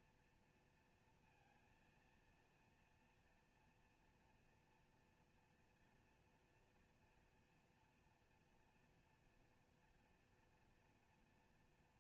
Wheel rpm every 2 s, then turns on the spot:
230, 230, 240, 230, 230, 240.
none